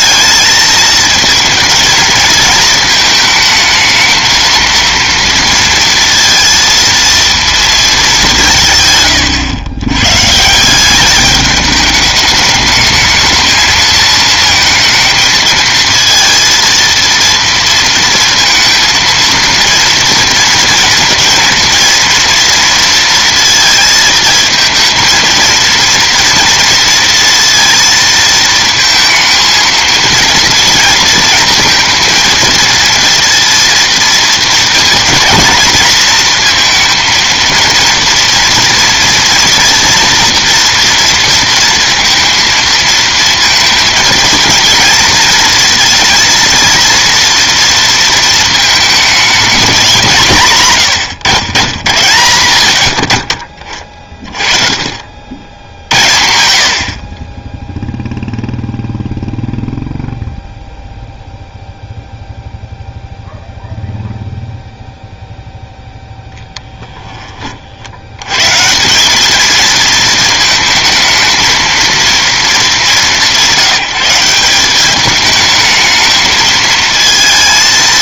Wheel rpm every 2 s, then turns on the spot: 220, 220, 230, 230, 170, 160, 210, 220, 230, 230, 230, 230, 220, 230, 230, 230, 230, 220, 230, 230, 240, 230, 230, 230, 220, 150, 80, 30, 70, 0, 0, 0, 0, 0, 120, 220, 220, 190, 220.
none